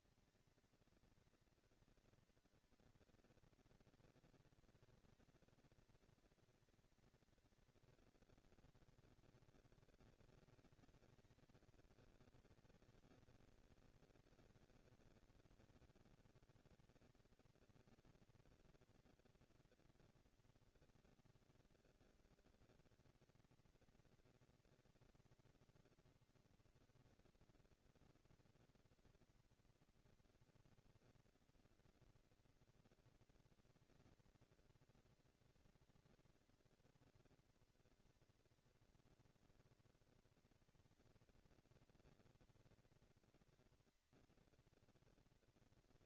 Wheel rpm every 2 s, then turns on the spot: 230, 230, 240, 230, 230, 220, 200, 200, 210, 230, 230, 220, 220, 230, 230, 230, 230, 230, 230, 230, 220, 240, 230.
none